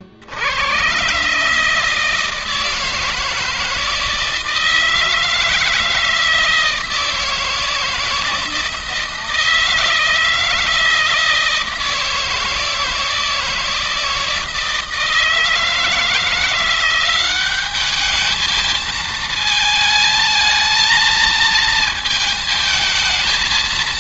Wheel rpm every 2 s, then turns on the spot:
90, 160, 160, 160, 160, 160, 160, 160, 170, 220, 220, 220.
none